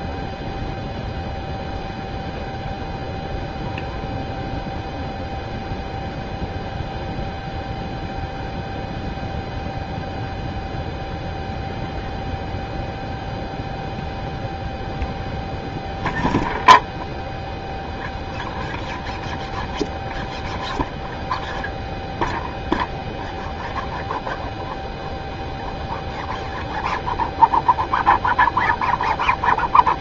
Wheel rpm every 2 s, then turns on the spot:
0, 0, 0, 0, 0, 0, 0, 0, 0, 0, 0, 0, 0, 0, 0.
none